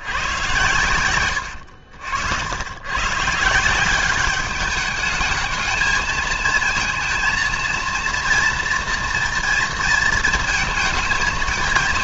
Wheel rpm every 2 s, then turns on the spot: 120, 100, 200, 230, 230, 220.
none